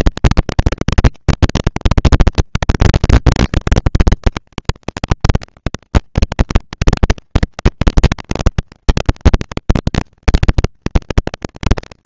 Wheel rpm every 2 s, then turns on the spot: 230, 230, 230, 200, 190, 210.
none